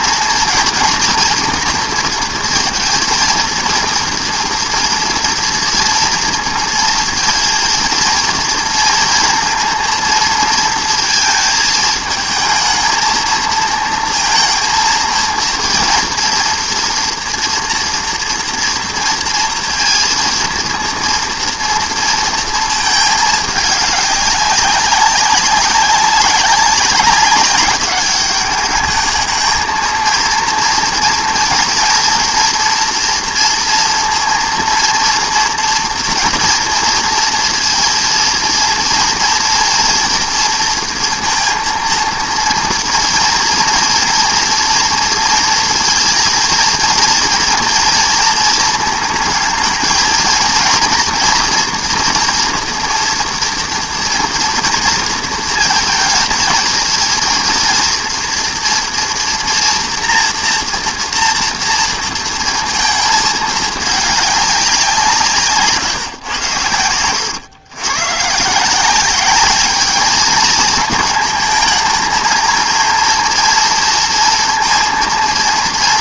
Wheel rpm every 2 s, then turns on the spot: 230, 230, 230, 230, 240, 230, 220, 230, 230, 230, 230, 230, 200, 200, 200, 230, 240, 230, 230, 230, 230, 230, 230, 230, 230, 220, 240, 230, 230, 230, 230, 230, 200, 120, 130, 220, 220, 230.
none